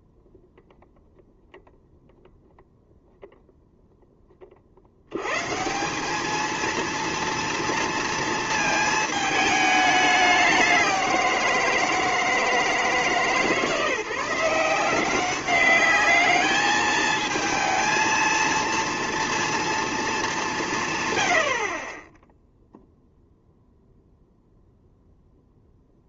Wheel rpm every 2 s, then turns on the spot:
0, 0, 50, 230, 220, 190, 160, 180, 210, 230, 170, 0, 0.
none